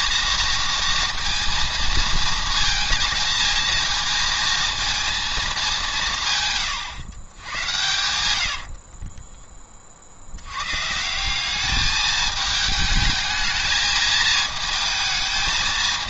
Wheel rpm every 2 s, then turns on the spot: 230, 230, 230, 130, 60, 130, 220, 220.
8-10